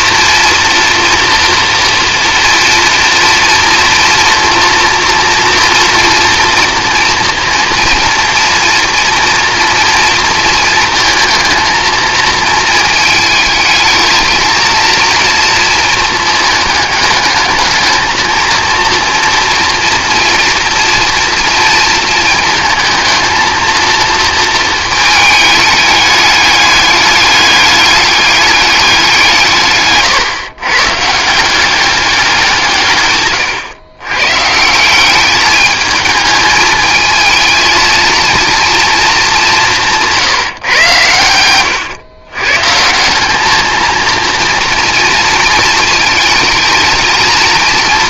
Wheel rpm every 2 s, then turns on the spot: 230, 230, 230, 230, 230, 220, 220, 230, 220, 230, 240, 220, 220, 210, 200, 130, 150, 170, 220, 230, 130, 150, 230, 220.
none